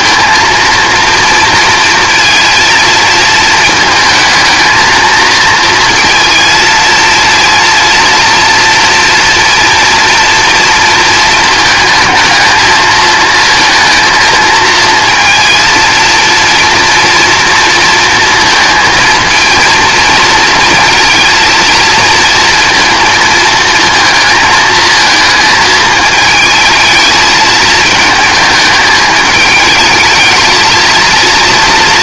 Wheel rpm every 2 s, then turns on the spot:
230, 230, 230, 230, 230, 230, 220, 230, 230, 230, 230, 230, 220, 220, 210, 220.
none